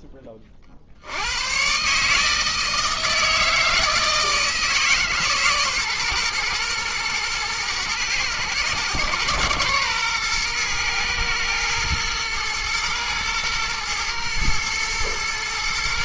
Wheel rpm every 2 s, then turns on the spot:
80, 160, 150, 120, 110, 120, 110, 120.
none